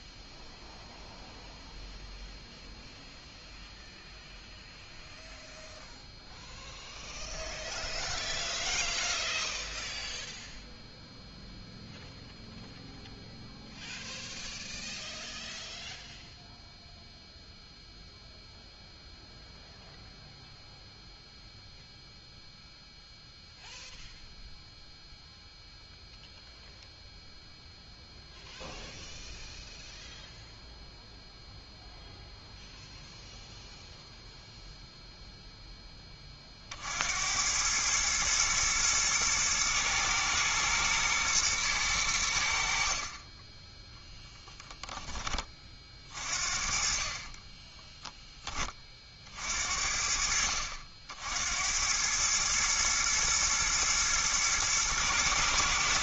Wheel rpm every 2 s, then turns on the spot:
0, 0, 0, 0, 0, 0, 0, 0, 0, 0, 0, 0, 0, 0, 0, 0, 0, 0, 50, 110, 110, 70, 10, 40, 20, 70, 110, 110.
none